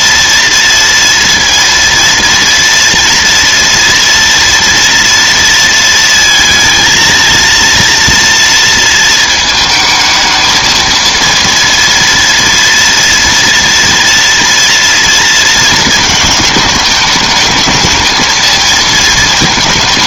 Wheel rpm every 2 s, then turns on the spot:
230, 230, 230, 230, 230, 220, 230, 230, 210, 220.
none